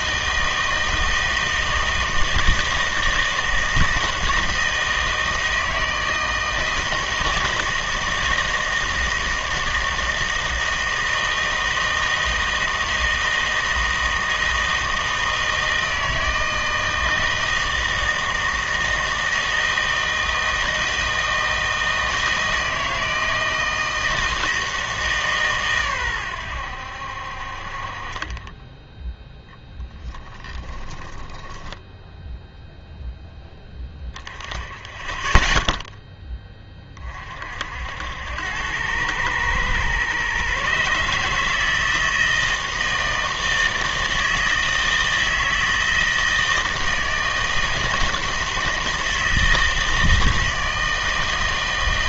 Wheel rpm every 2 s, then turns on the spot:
160, 160, 160, 160, 160, 160, 160, 160, 160, 160, 160, 160, 160, 90, 10, 20, 0, 10, 20, 90, 140, 160, 160, 160, 160, 160.
30-32